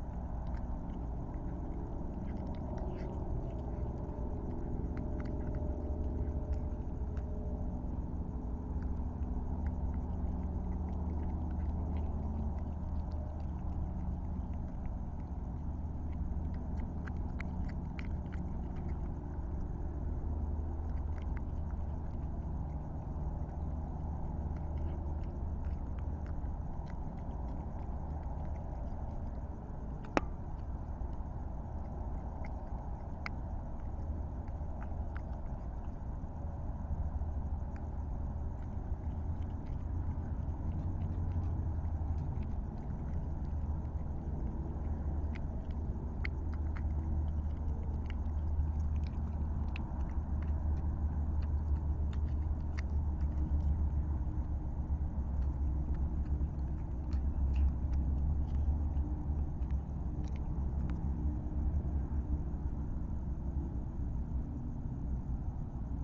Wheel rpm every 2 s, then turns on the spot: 0, 0, 0, 0, 0, 0, 0, 0, 0, 0, 0, 0, 0, 0, 0, 0, 0, 0, 0, 0, 0, 0, 0, 0, 0, 0, 0, 0, 0, 0, 0, 0, 0.
none